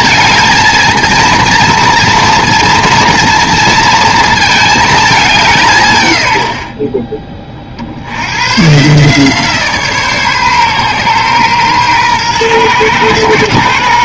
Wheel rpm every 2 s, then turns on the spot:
230, 230, 220, 40, 140, 130, 120.
none